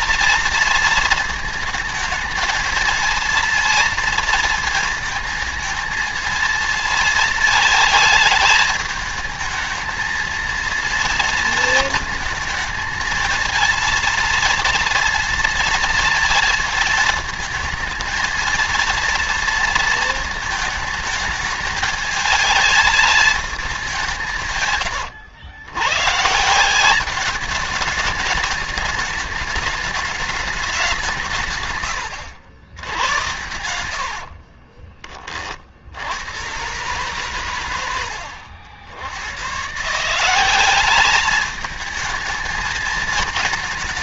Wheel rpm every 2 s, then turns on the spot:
230, 230, 230, 220, 210, 230, 220, 230, 220, 230, 220, 220, 110, 190, 210, 190, 90, 30, 120, 80, 200, 220.
34-36